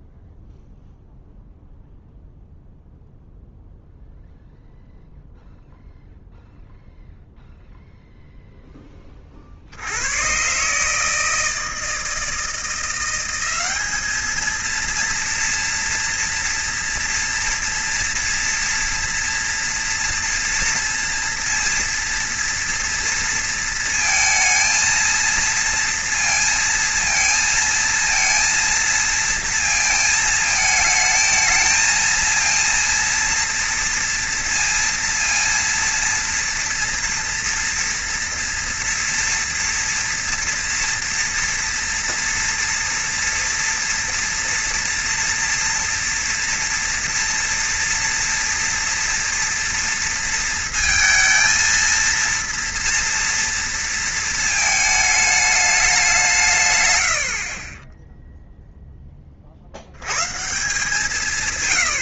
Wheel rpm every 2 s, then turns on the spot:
0, 0, 0, 0, 0, 130, 170, 230, 230, 230, 230, 230, 230, 230, 230, 220, 230, 230, 230, 230, 230, 230, 230, 230, 230, 230, 230, 220, 150, 0, 150.
none